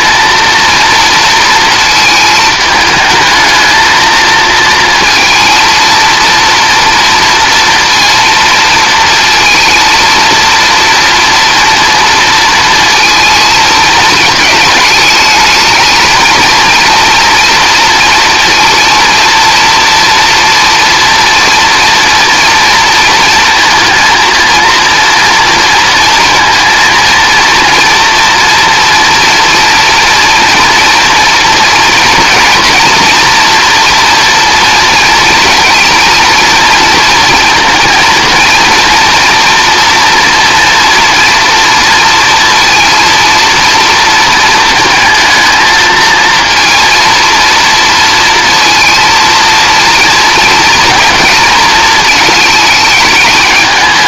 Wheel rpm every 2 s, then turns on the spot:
230, 220, 230, 230, 230, 230, 230, 220, 230, 230, 230, 230, 230, 230, 230, 240, 240, 230, 230, 230, 230, 230, 220, 230, 230, 230, 220.
none